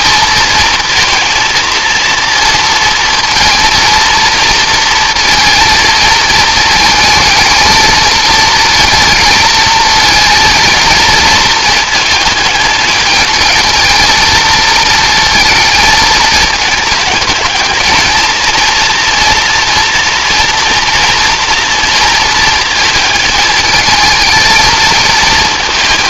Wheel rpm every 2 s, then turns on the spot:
230, 230, 230, 220, 220, 230, 220, 220, 220, 230, 230, 220, 220.
none